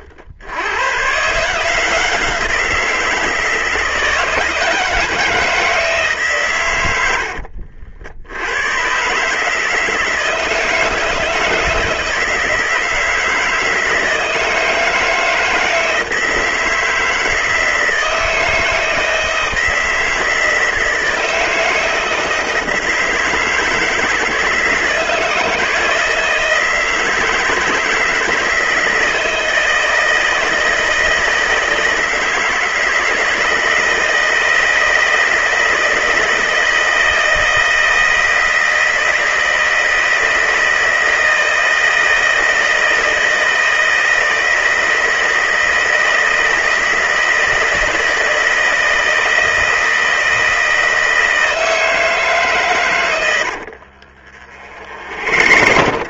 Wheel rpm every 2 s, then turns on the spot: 110, 170, 160, 110, 120, 160, 160, 160, 170, 160, 160, 160, 160, 160, 160, 160, 160, 160, 160, 160, 160, 160, 160, 160, 160, 160, 120, 60.
54-56